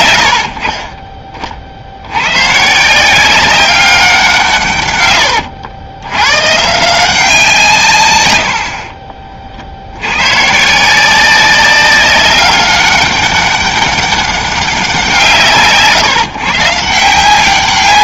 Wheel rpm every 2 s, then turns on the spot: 50, 150, 130, 150, 60, 150, 200, 190, 160.
none